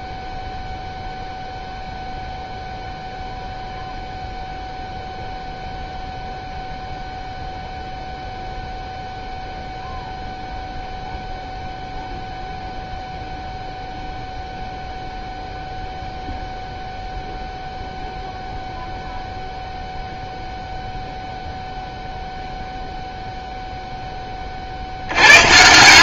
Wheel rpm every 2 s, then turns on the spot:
0, 0, 0, 0, 0, 0, 0, 0, 0, 0, 0, 0, 40.
none